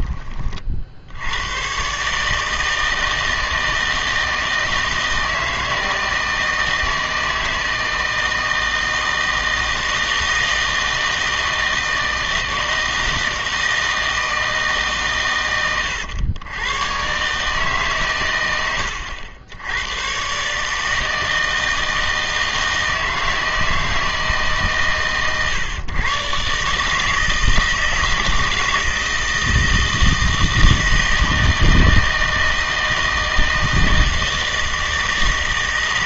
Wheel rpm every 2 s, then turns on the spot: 50, 160, 160, 160, 160, 160, 160, 150, 110, 100, 150, 160, 130, 140, 160, 160, 160, 160.
none